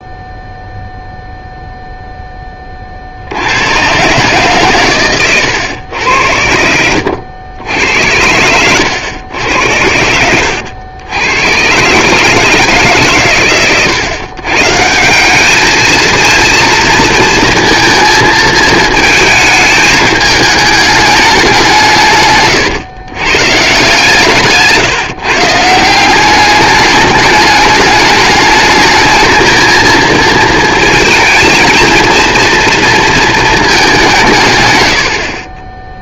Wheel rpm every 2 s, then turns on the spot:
0, 70, 110, 90, 110, 100, 110, 180, 230, 220, 200, 130, 150, 210, 220, 230, 230, 60.
none